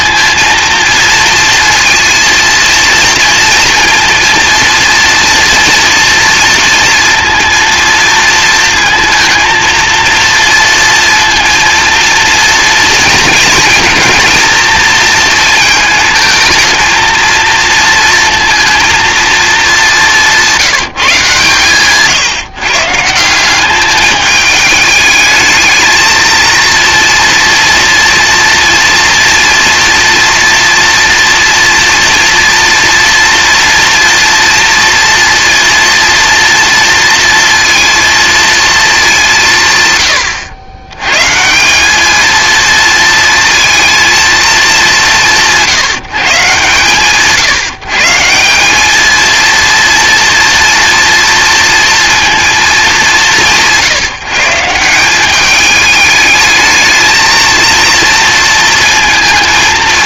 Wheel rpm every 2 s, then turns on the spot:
230, 230, 230, 240, 230, 230, 230, 230, 220, 230, 180, 150, 210, 230, 230, 230, 240, 230, 230, 220, 110, 230, 210, 140, 190, 230, 210, 170, 220, 220.
none